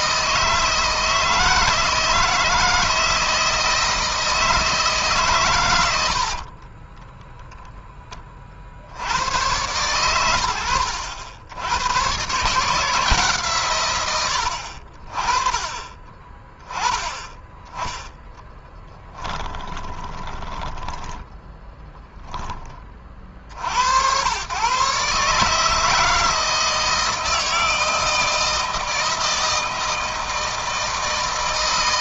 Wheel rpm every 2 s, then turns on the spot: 160, 160, 160, 30, 40, 80, 140, 80, 20, 10, 20, 20, 120, 160, 160, 160.
6-8 20-22